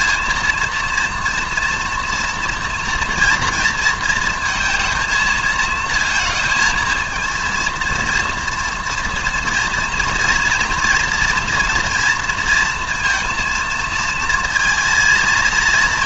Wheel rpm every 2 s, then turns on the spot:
230, 230, 230, 220, 230, 230, 230, 230.
none